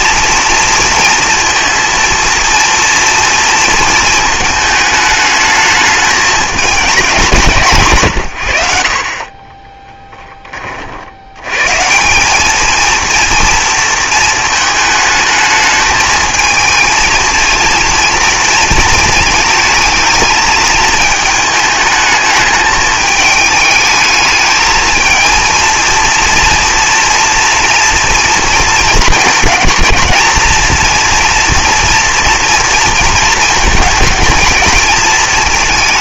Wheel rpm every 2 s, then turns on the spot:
230, 230, 220, 210, 80, 40, 220, 220, 230, 230, 220, 210, 220, 230, 220, 220, 240, 220.
none